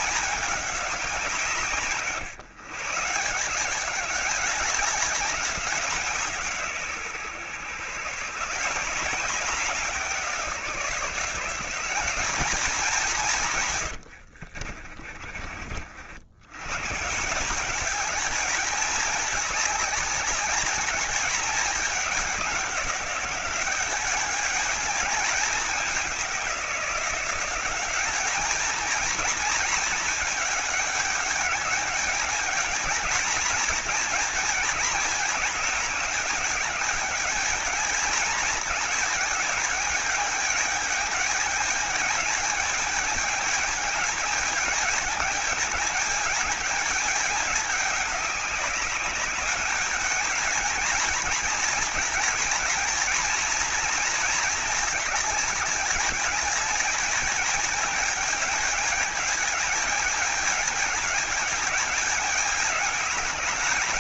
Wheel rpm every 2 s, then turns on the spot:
180, 150, 190, 130, 170, 170, 180, 50, 140, 210, 210, 190, 210, 190, 220, 210, 220, 210, 210, 220, 210, 220, 220, 210, 200, 220, 220, 200, 220, 220, 210, 200.
14-16